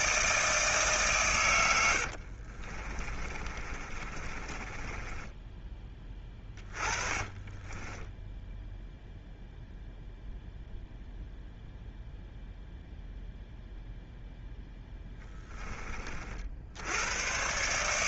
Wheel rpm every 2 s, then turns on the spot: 160, 50, 30, 20, 0, 0, 0, 0, 50.
2-8